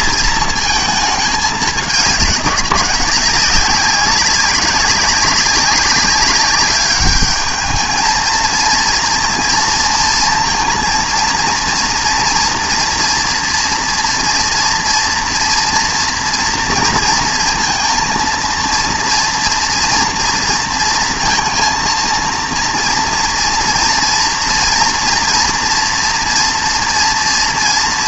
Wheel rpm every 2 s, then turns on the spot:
230, 190, 190, 200, 230, 230, 230, 230, 240, 230, 230, 230, 230, 240.
none